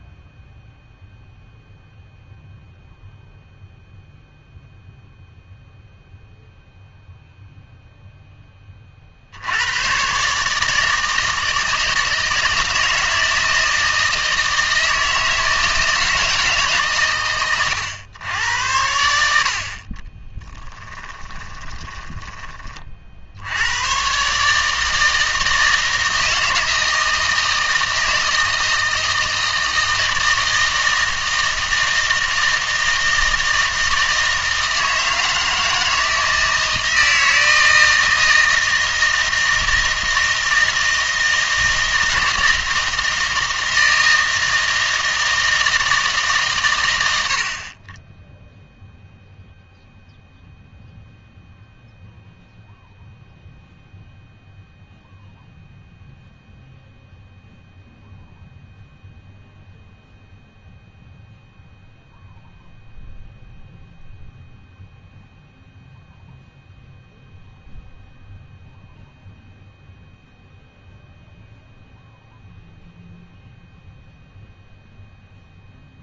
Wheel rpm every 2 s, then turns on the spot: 0, 0, 0, 0, 20, 150, 160, 160, 150, 90, 10, 20, 150, 160, 160, 160, 160, 160, 160, 160, 160, 160, 160, 130, 0, 0, 0, 0, 0, 0, 0, 0, 0, 0, 0, 0, 0, 0.
20-22